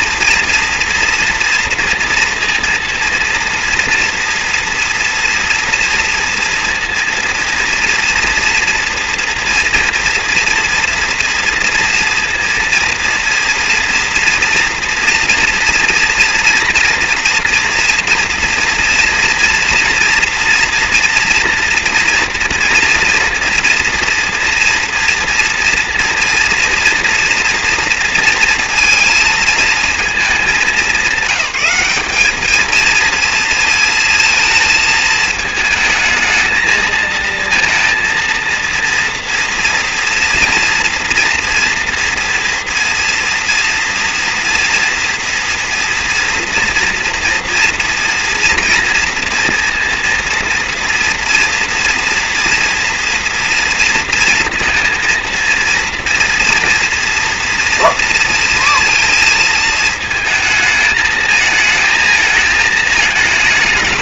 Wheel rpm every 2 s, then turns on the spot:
240, 230, 230, 230, 230, 230, 230, 230, 230, 240, 230, 230, 230, 240, 230, 220, 220, 220, 220, 230, 230, 230, 230, 230, 230, 230, 230, 230, 230, 230, 220, 220.
none